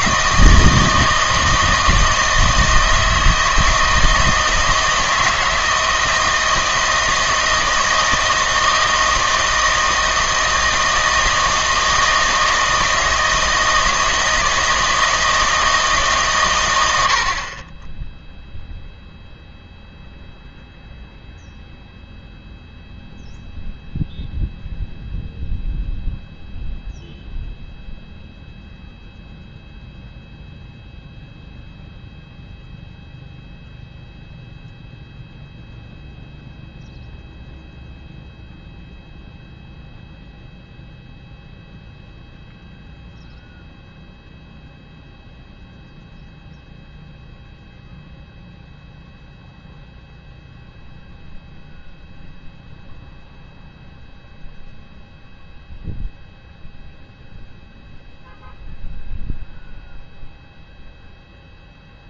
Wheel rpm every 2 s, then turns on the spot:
160, 160, 160, 160, 160, 160, 160, 160, 110, 0, 0, 0, 0, 0, 0, 0, 0, 0, 0, 0, 0, 0, 0, 0, 0, 0, 0, 0, 0, 0, 0.
none